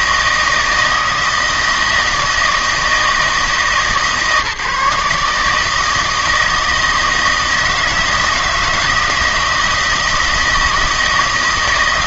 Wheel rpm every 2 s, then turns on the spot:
160, 160, 150, 160, 160, 160.
none